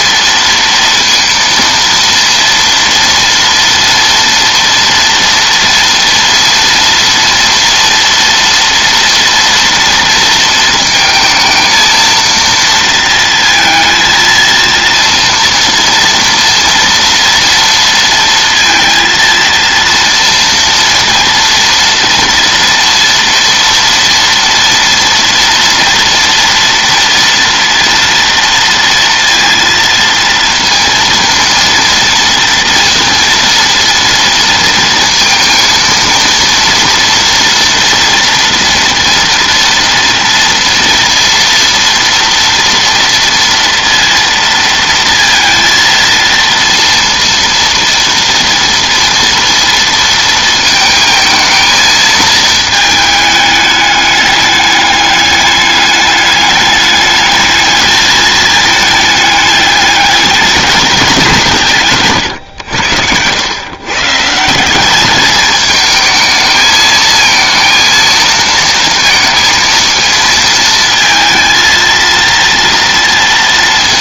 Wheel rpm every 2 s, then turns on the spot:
230, 230, 230, 230, 230, 220, 230, 230, 230, 230, 230, 230, 230, 230, 230, 230, 230, 230, 240, 230, 230, 230, 230, 230, 230, 230, 220, 210, 210, 210, 210, 100, 180, 220, 230, 230, 230.
none